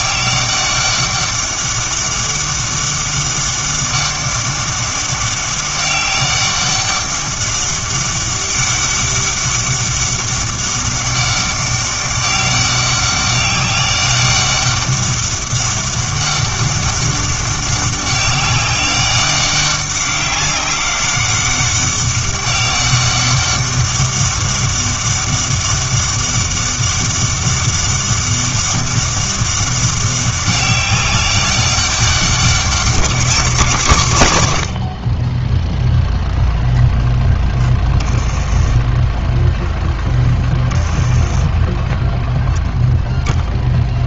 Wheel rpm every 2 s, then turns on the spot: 200, 200, 200, 200, 200, 200, 200, 200, 200, 200, 200, 200, 200, 200, 200, 200, 190, 100, 0, 20, 20, 0.
none